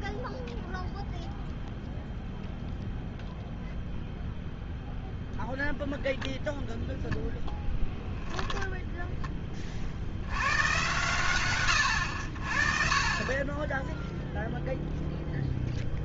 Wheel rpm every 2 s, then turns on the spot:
0, 0, 0, 0, 0, 120, 40, 0.
none